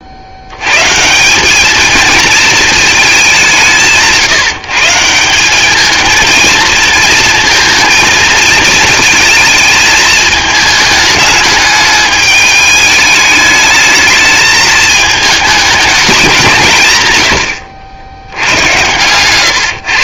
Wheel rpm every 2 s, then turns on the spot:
110, 220, 160, 220, 220, 210, 210, 220, 160, 110.
18-20